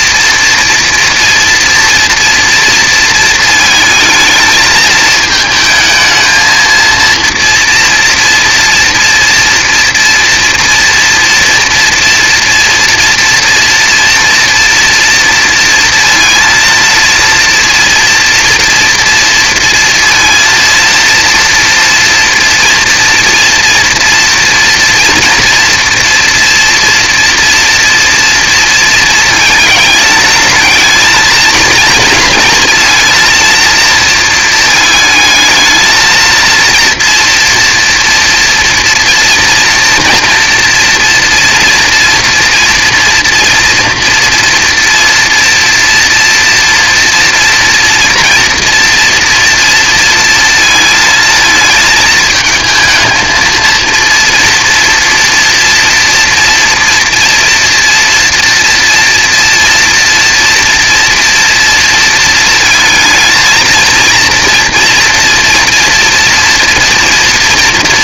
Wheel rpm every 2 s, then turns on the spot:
230, 230, 220, 230, 240, 230, 240, 230, 230, 230, 230, 230, 240, 240, 230, 220, 230, 230, 230, 230, 230, 230, 230, 230, 230, 220, 220, 230, 230, 230, 230, 230, 240, 230.
none